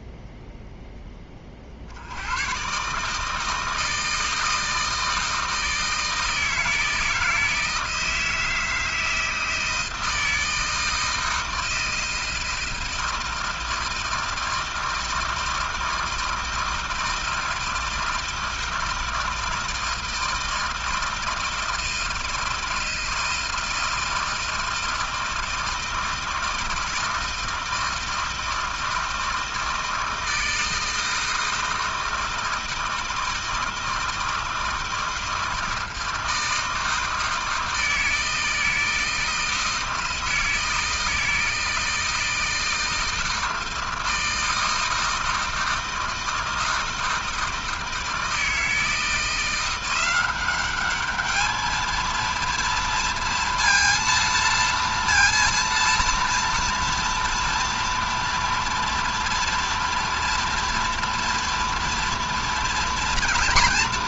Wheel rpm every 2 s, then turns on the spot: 0, 110, 160, 160, 160, 160, 160, 160, 160, 160, 160, 160, 160, 160, 160, 160, 160, 160, 160, 160, 160, 160, 160, 160, 160, 190, 230, 230, 230, 230, 230, 240.
none